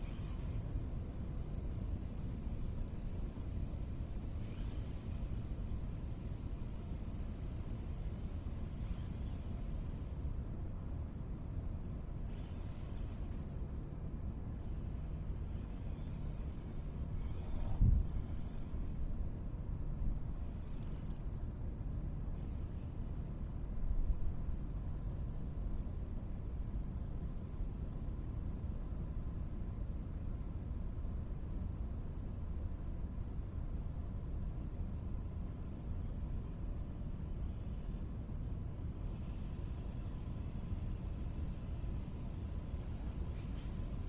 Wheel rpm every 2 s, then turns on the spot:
0, 0, 0, 0, 0, 0, 0, 0, 0, 0, 0, 0, 0, 0, 0, 0, 0, 0, 0, 0, 0, 0.
none